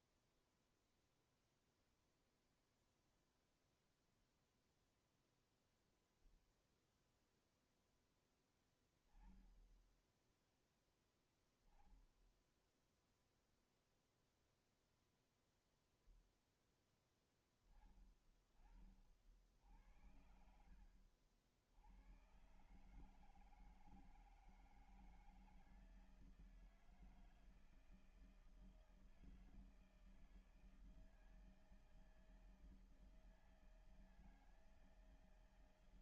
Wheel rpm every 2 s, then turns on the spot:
0, 0, 0, 0, 10, 10, 10, 0, 0, 30, 70, 120, 160, 160, 160, 160, 160, 160.
none